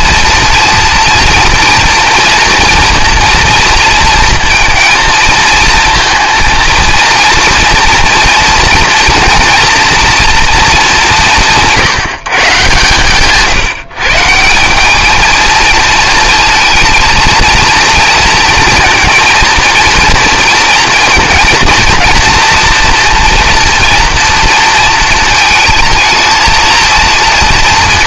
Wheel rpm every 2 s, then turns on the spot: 230, 230, 230, 230, 230, 210, 140, 200, 230, 230, 230, 230, 230, 230.
none